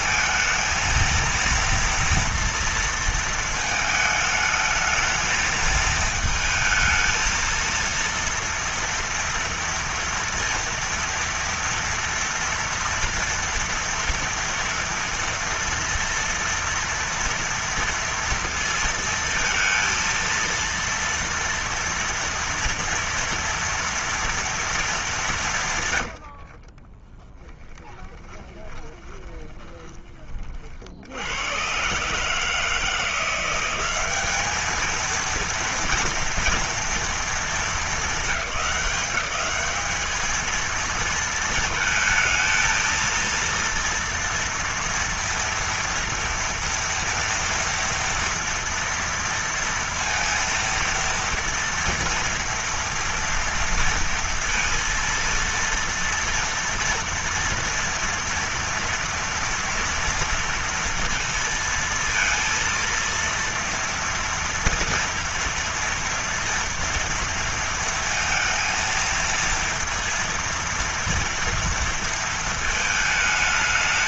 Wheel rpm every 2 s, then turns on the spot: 230, 230, 220, 220, 230, 230, 230, 230, 230, 230, 230, 230, 230, 50, 20, 50, 160, 220, 240, 190, 220, 230, 230, 230, 230, 230, 230, 230, 230, 230, 230, 230, 230, 230, 230, 230, 220.
26-30